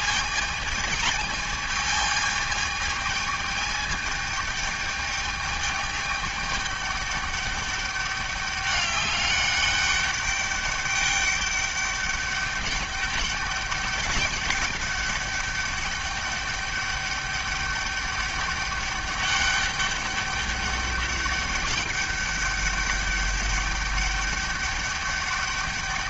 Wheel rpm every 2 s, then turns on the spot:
220, 210, 210, 200, 200, 200, 200, 200, 200, 200, 200, 200, 200.
none